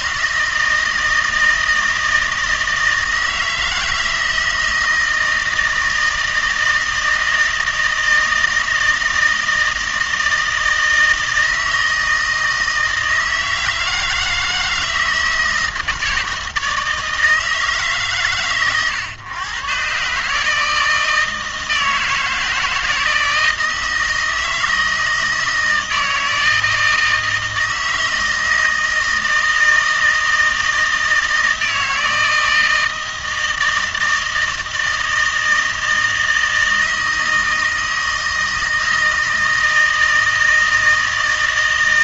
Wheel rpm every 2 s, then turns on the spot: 160, 160, 160, 160, 160, 160, 160, 160, 160, 110, 150, 160, 160, 160, 160, 160, 160, 160, 160, 160, 160.
none